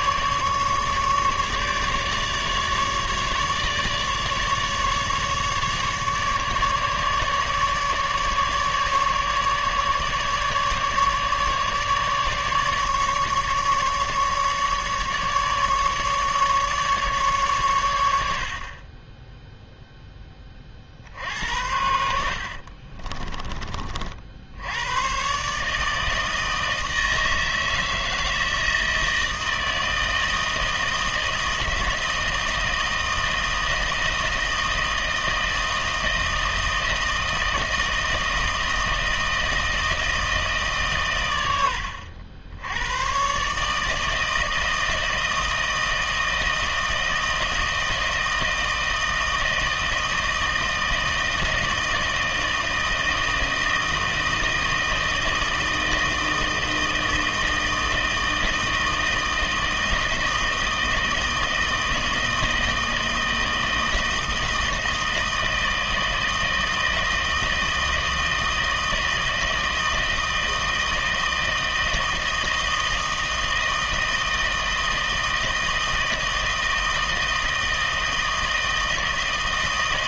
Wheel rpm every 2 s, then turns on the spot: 150, 150, 150, 150, 150, 150, 150, 150, 150, 60, 20, 70, 70, 160, 160, 160, 160, 160, 160, 160, 160, 80, 160, 160, 160, 160, 160, 160, 160, 160, 160, 160, 160, 160, 160, 160, 160, 160, 160, 160.
22-24